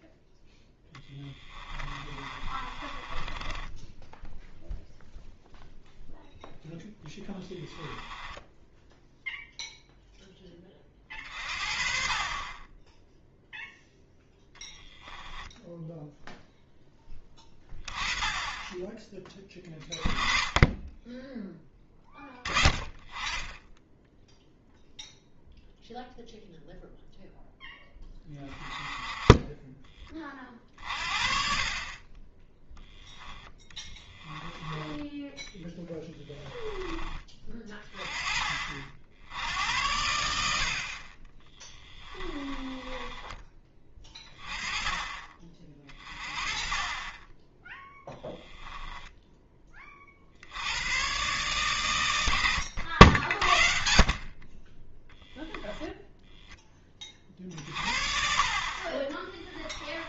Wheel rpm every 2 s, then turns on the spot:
0, 20, 0, 10, 0, 30, 10, 10, 20, 20, 20, 20, 0, 0, 20, 40, 0, 10, 10, 50, 50, 20, 20, 30, 10, 100, 80, 20, 20, 40.
2-4 14-16 34-36 42-44